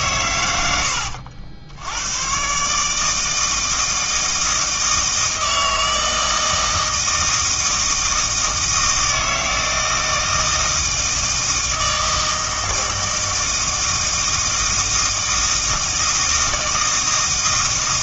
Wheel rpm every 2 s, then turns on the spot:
100, 130, 160, 160, 160, 160, 160, 160, 160.
none